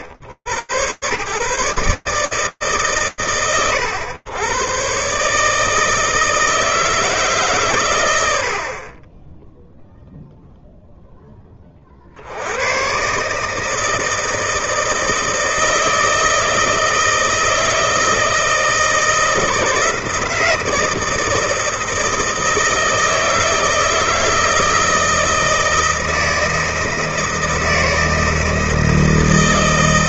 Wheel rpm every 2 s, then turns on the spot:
90, 150, 100, 160, 70, 0, 110, 160, 160, 160, 160, 160, 160, 160, 160.
none